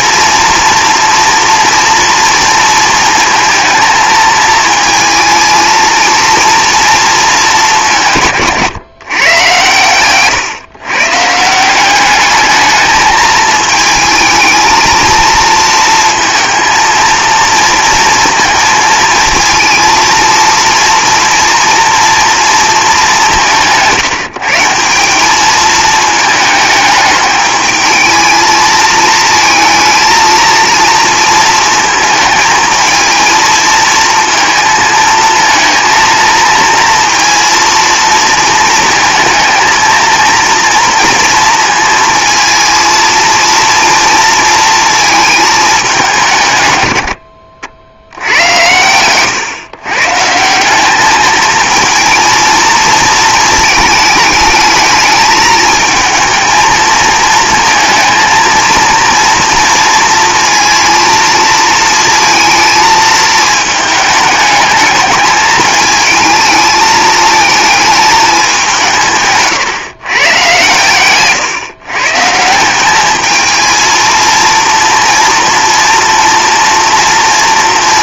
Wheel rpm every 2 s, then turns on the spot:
230, 230, 220, 230, 130, 130, 210, 220, 230, 230, 230, 220, 180, 220, 220, 230, 220, 230, 230, 230, 230, 220, 230, 110, 100, 190, 230, 220, 220, 230, 230, 230, 210, 220, 180, 130, 190, 230, 230.
48-50